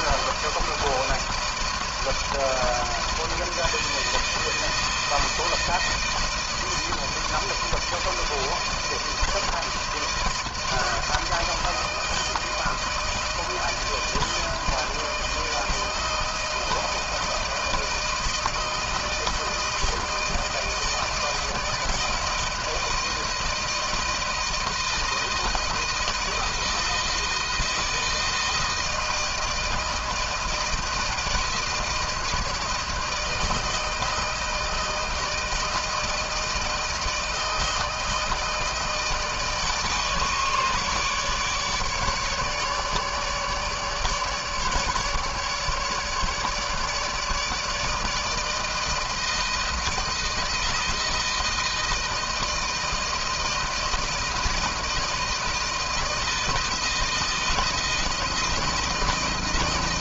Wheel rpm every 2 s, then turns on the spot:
160, 160, 160, 160, 160, 160, 160, 160, 160, 160, 160, 160, 170, 160, 160, 160, 160, 160, 160, 160, 150, 150, 150, 150, 160, 160, 160, 160, 160, 160.
none